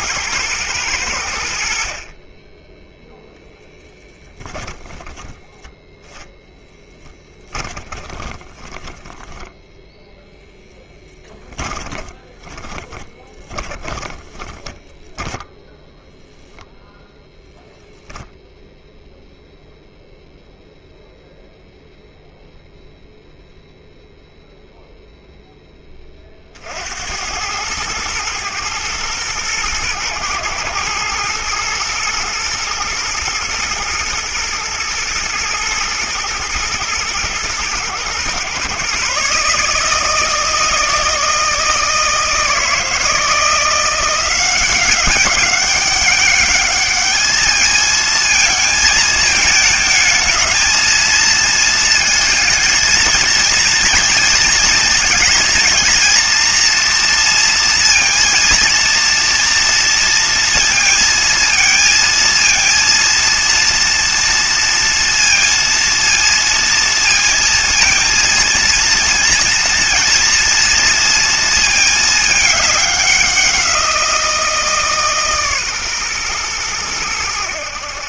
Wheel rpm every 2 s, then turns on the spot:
110, 10, 10, 10, 10, 0, 20, 10, 0, 0, 0, 0, 0, 60, 110, 110, 110, 110, 110, 130, 160, 160, 190, 210, 220, 230, 220, 230, 230, 230, 230, 230, 230, 230, 230, 230, 210, 160, 110.
4-10 12-16